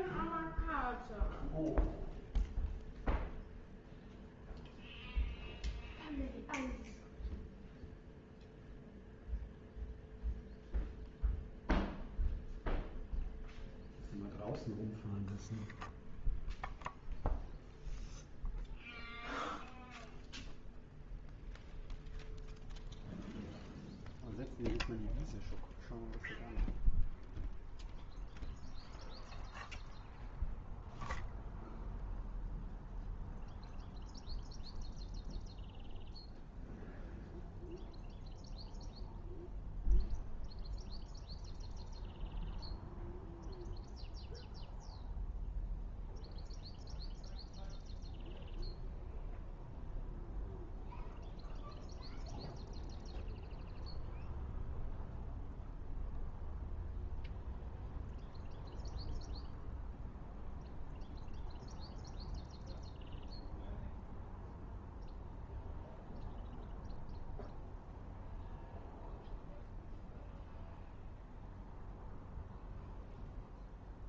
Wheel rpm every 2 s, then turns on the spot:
0, 0, 0, 0, 0, 0, 0, 0, 0, 0, 0, 0, 0, 0, 0, 0, 0, 0, 0, 0, 0, 0, 0, 0, 0, 0, 0, 0, 0, 0, 0, 0, 0, 0, 0, 0, 0.
none